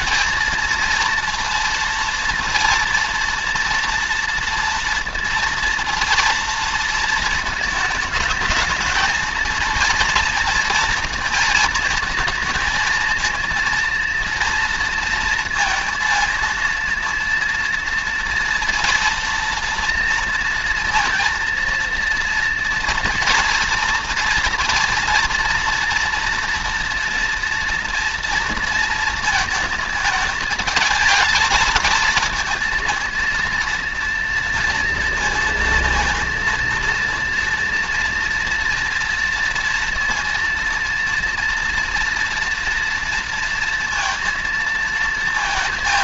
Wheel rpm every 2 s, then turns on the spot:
230, 230, 230, 230, 220, 230, 220, 230, 230, 230, 230, 230, 230, 230, 230, 220, 220, 230, 230, 240, 230, 230, 230.
none